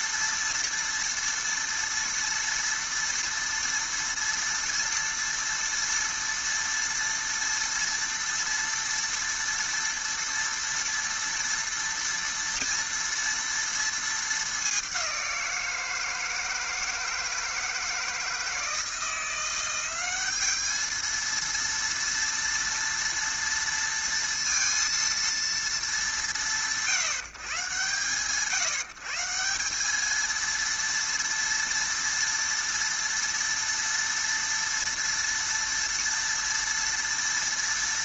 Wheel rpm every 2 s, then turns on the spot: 230, 240, 230, 230, 230, 230, 230, 190, 160, 160, 220, 230, 230, 150, 150, 230, 230, 230, 230.
none